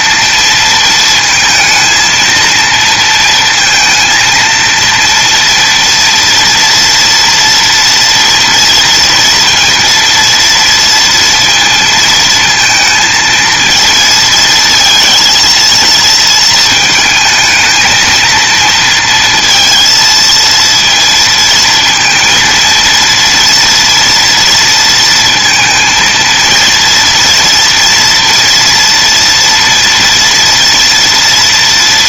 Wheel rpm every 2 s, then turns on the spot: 220, 230, 230, 230, 230, 230, 230, 230, 220, 230, 230, 230, 230, 240, 230, 230.
none